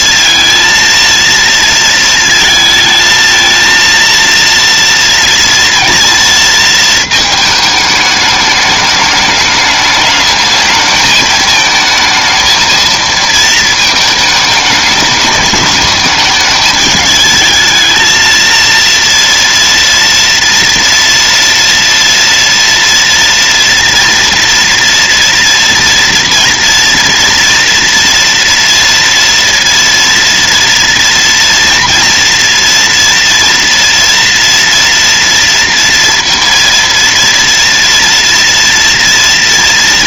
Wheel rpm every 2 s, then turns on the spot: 230, 230, 230, 230, 210, 220, 220, 220, 220, 230, 230, 230, 230, 230, 230, 230, 230, 230, 230, 230.
none